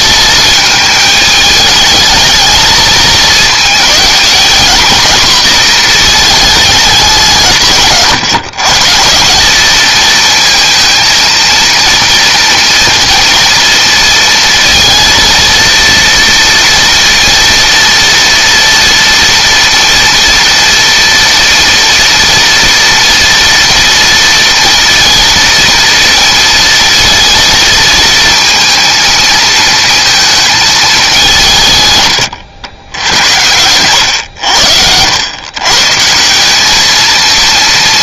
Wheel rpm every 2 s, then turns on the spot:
220, 220, 230, 210, 150, 230, 240, 230, 230, 230, 230, 230, 230, 230, 230, 220, 90, 90, 210.
none